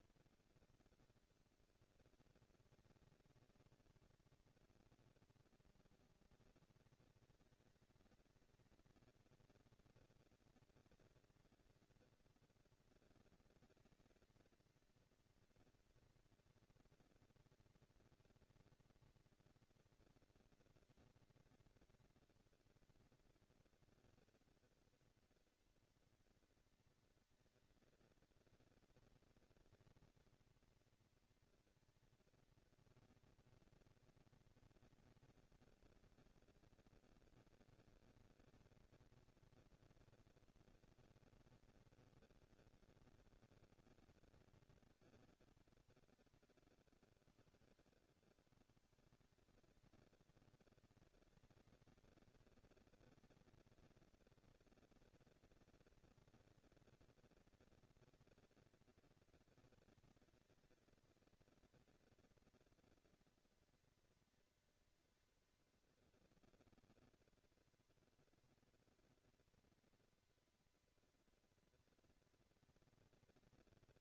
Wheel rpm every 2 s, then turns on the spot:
210, 200, 220, 230, 230, 230, 230, 230, 240, 230, 230, 230, 230, 230, 230, 240, 230, 230, 230, 240, 230, 230, 220, 130, 110, 200, 230, 230, 230, 230, 230, 230, 230, 230, 230, 230, 230.
none